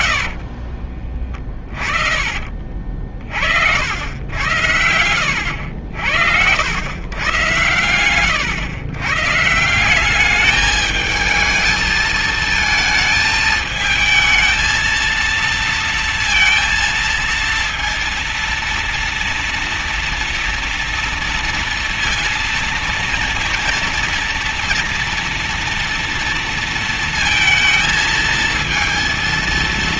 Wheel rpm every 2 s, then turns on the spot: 50, 60, 100, 110, 120, 220, 220, 220, 230, 230, 230, 230, 230, 230, 230.
0-2 4-6